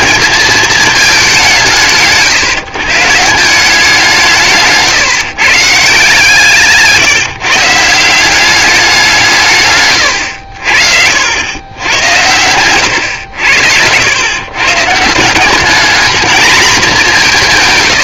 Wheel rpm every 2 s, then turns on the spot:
220, 150, 160, 160, 190, 70, 100, 140, 220.
4-6